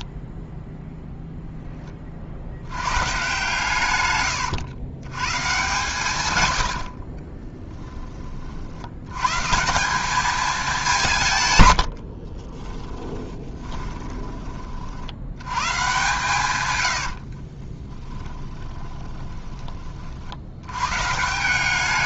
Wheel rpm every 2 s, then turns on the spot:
0, 120, 120, 70, 80, 180, 20, 80, 80, 20, 120.
6-8 12-14 16-20